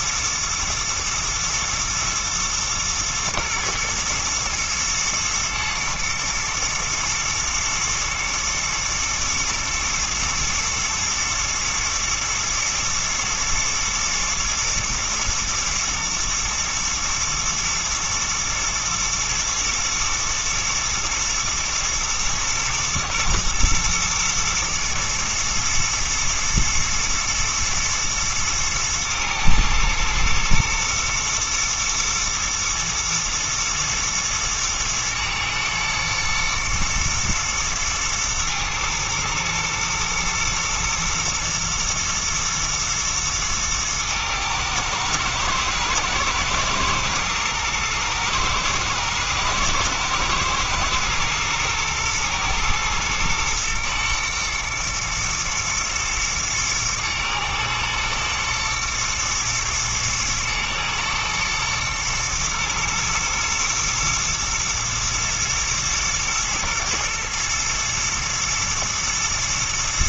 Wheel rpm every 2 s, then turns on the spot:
120, 120, 120, 120, 120, 120, 120, 110, 110, 110, 120, 110, 120, 110, 110, 120, 110, 110, 110, 110, 110, 110, 110, 110, 120, 110, 110, 110, 110, 120, 120, 120, 110, 110, 110.
none